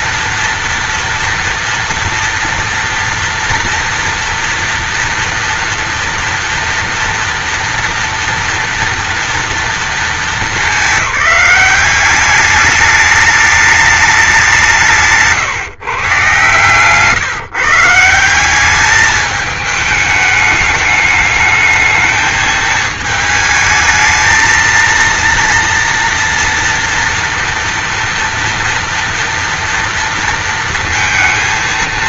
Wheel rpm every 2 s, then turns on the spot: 230, 230, 230, 230, 230, 200, 210, 170, 160, 210, 210, 220, 230, 240, 230, 230.
none